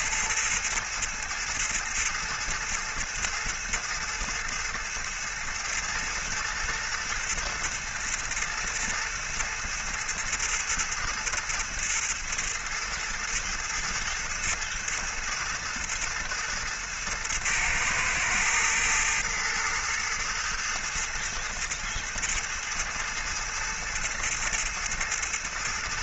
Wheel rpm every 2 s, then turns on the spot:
110, 110, 110, 110, 110, 110, 110, 110, 110, 110, 110, 110, 110.
none